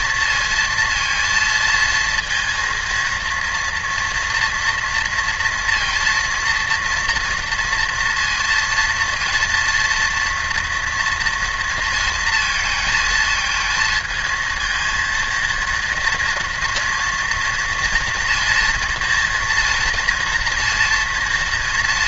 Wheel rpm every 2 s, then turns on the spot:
230, 230, 230, 230, 230, 230, 220, 230, 240, 240, 230.
none